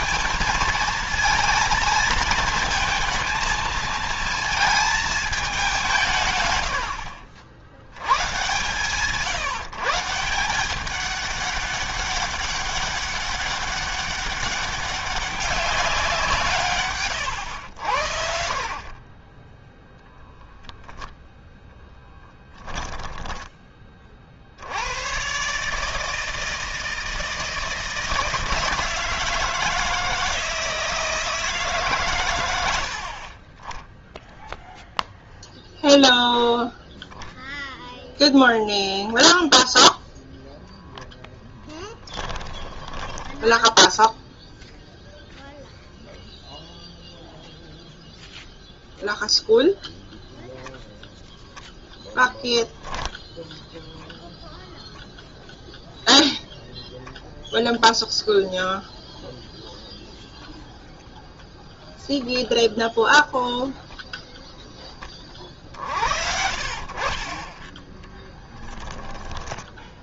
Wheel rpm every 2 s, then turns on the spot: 220, 230, 220, 80, 150, 180, 190, 200, 130, 40, 0, 10, 100, 160, 160, 160, 60, 0, 0, 0, 0, 10, 0, 0, 0, 0, 10, 0, 0, 0, 0, 0, 10, 60, 10.
16-18 42-44 66-68